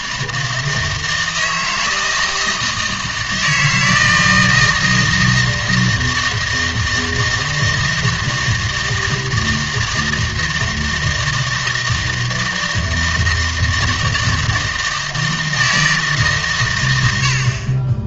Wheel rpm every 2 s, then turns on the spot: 160, 160, 160, 160, 160, 160, 160, 160, 120.
none